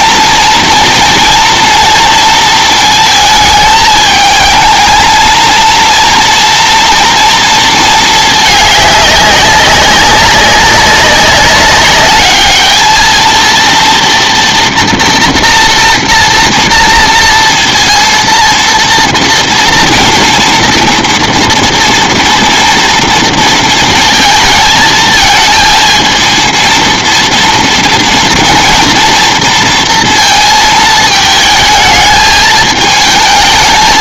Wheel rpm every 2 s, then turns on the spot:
230, 220, 220, 230, 210, 200, 220, 240, 230, 240, 230, 230, 220, 230, 230, 220, 220.
none